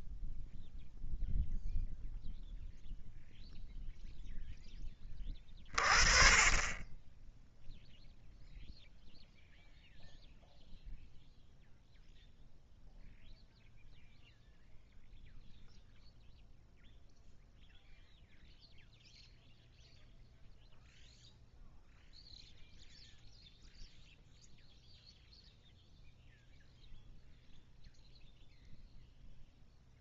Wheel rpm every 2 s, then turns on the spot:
0, 0, 10, 20, 0, 0, 0, 0, 0, 0, 0, 0, 0, 0, 0.
none